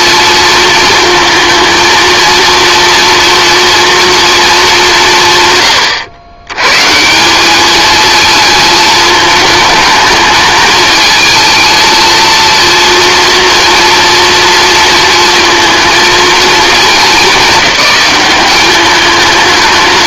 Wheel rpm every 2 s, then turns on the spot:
230, 230, 210, 130, 220, 220, 230, 230, 220, 200.
none